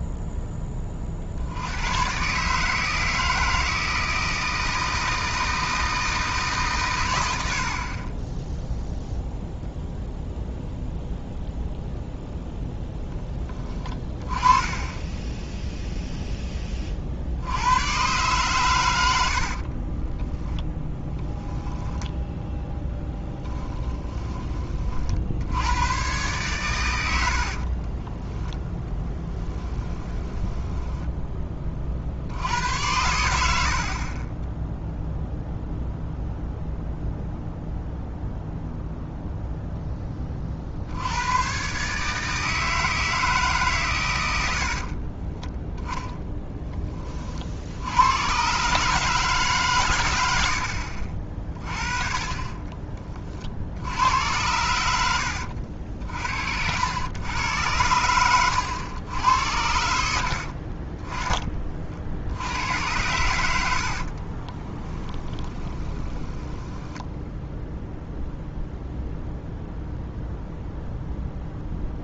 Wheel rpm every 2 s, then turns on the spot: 30, 160, 160, 130, 0, 0, 0, 20, 30, 100, 10, 10, 40, 110, 10, 10, 90, 0, 0, 0, 60, 160, 50, 20, 150, 60, 30, 90, 80, 90, 40, 90, 20, 10, 0, 0.
20-22 28-32 44-46 54-56 60-62 64-68